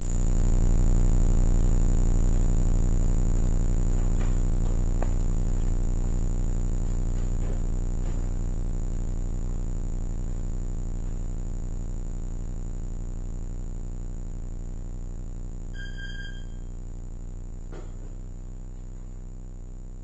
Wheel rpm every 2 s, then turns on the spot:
0, 0, 0, 0, 0, 0, 0, 0, 0, 0.
none